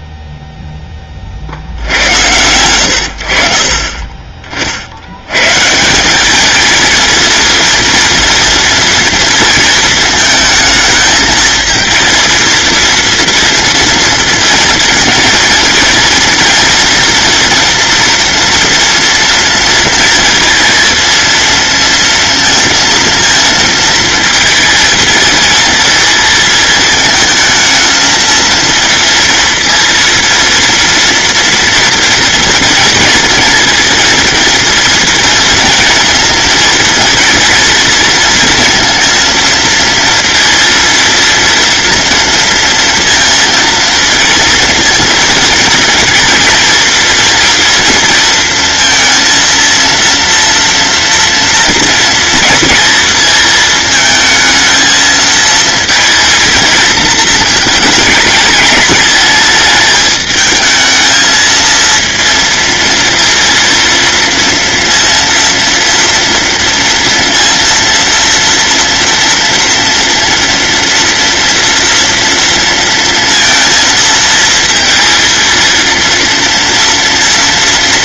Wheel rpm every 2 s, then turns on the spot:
10, 90, 60, 230, 230, 220, 230, 230, 240, 230, 230, 230, 230, 220, 230, 230, 230, 230, 230, 230, 230, 230, 230, 230, 230, 240, 230, 220, 230, 210, 220, 230, 230, 230, 230, 230, 230, 230, 230.
none